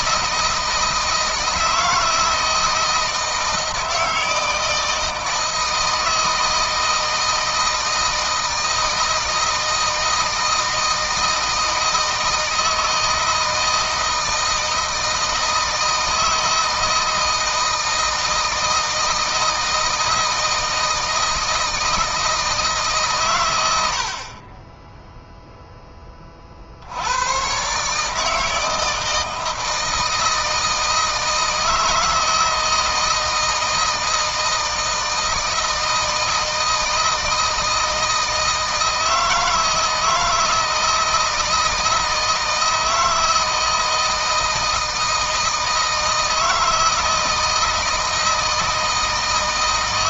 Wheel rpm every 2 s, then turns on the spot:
160, 160, 160, 160, 160, 160, 160, 160, 160, 160, 160, 150, 20, 60, 160, 160, 160, 160, 160, 160, 160, 160, 160, 160, 160.
none